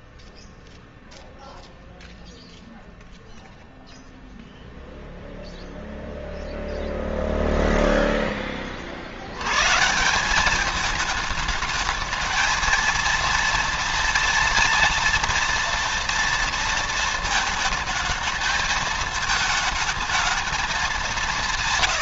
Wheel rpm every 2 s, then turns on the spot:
0, 0, 0, 0, 60, 210, 230, 230, 230, 220, 190.
none